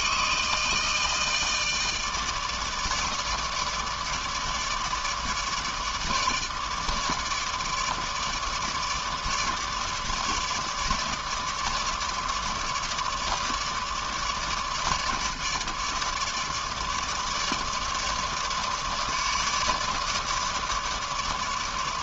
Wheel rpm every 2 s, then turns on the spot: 160, 150, 150, 150, 150, 150, 150, 150, 150, 150, 150.
none